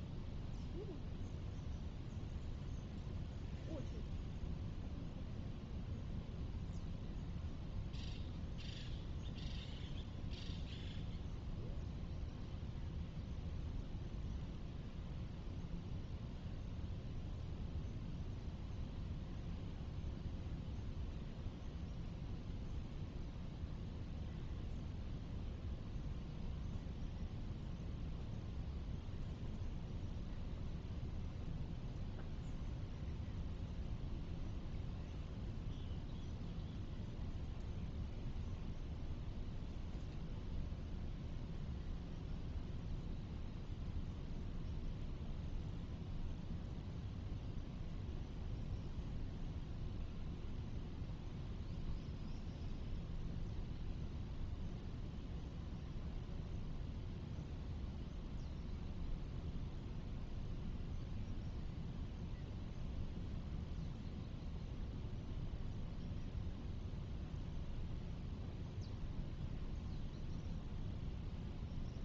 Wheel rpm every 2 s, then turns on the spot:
0, 0, 0, 0, 0, 0, 0, 0, 0, 0, 0, 0, 0, 0, 0, 0, 0, 0, 0, 0, 0, 0, 0, 0, 0, 0, 0, 0, 0, 0, 0, 0, 0, 0, 0, 0.
none